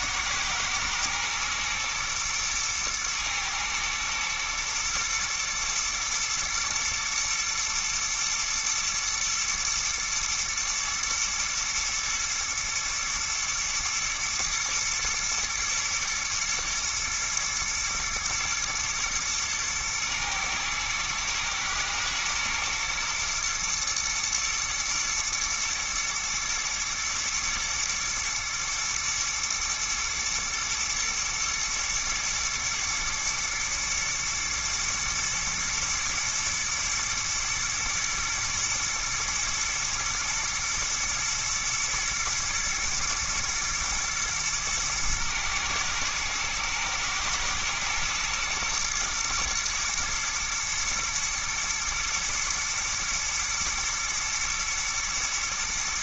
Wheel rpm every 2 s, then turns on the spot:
110, 120, 120, 120, 110, 120, 120, 110, 120, 110, 110, 120, 110, 110, 110, 110, 120, 120, 110, 120, 110, 110, 110, 120, 110, 110, 120, 120.
none